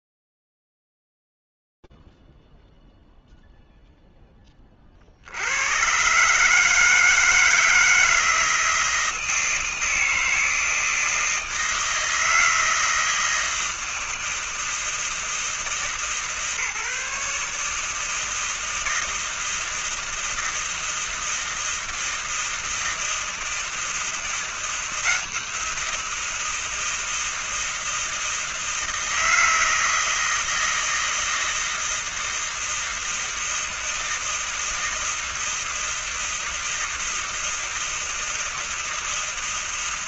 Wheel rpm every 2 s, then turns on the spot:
0, 0, 0, 120, 160, 160, 160, 170, 160, 150, 160, 160, 160, 170, 160, 160, 160, 160, 160, 160.
none